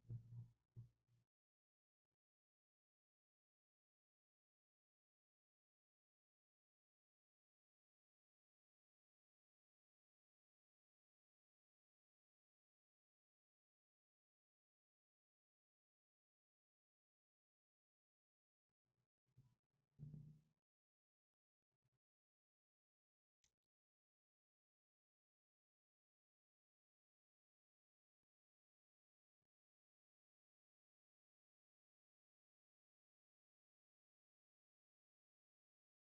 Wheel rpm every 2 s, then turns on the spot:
0, 0, 0, 0, 0, 0, 0, 0, 0, 0, 0, 0, 0, 0, 0, 0, 0, 0.
none